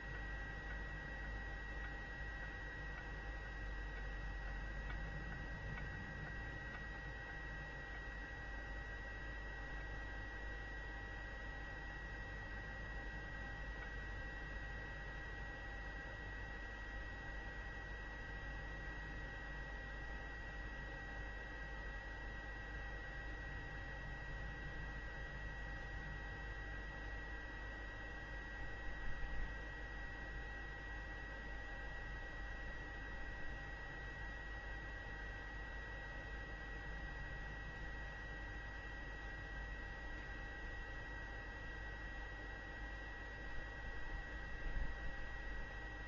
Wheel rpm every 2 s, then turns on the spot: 0, 0, 0, 0, 0, 0, 0, 0, 0, 0, 0, 0, 0, 0, 0, 0, 0, 0, 0, 0, 0, 0, 0.
none